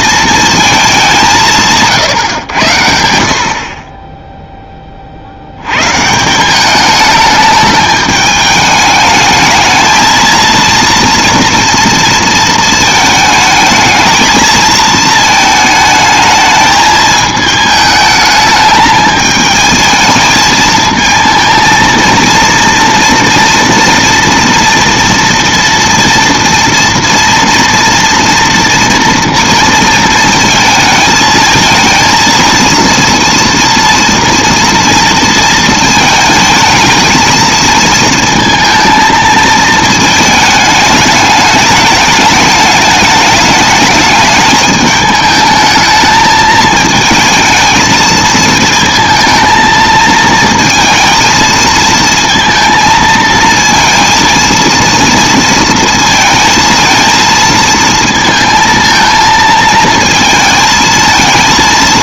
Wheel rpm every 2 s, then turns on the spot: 220, 110, 10, 190, 210, 230, 220, 220, 220, 210, 220, 230, 230, 230, 230, 220, 230, 230, 220, 230, 220, 210, 210, 220, 230, 220, 230, 230, 230, 230, 220.
none